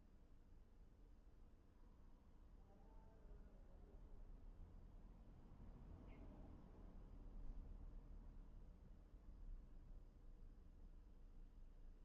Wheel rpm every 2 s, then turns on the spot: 0, 0, 0, 0, 0, 0.
none